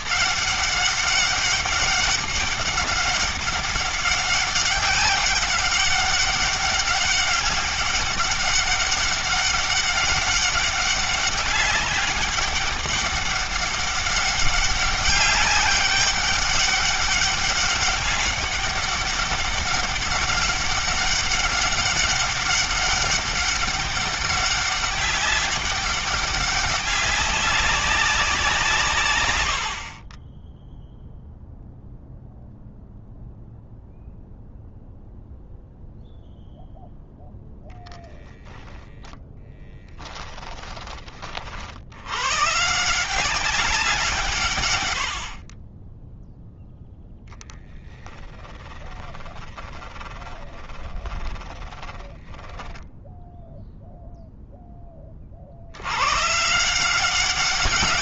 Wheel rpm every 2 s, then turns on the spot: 200, 200, 200, 200, 200, 200, 200, 200, 200, 200, 200, 200, 200, 200, 140, 0, 0, 0, 0, 10, 30, 170, 80, 0, 10, 10, 10, 20, 180.
38-40 48-54